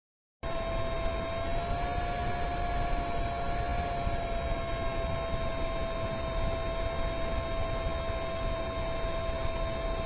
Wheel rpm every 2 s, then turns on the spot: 0, 0, 0, 0, 0.
none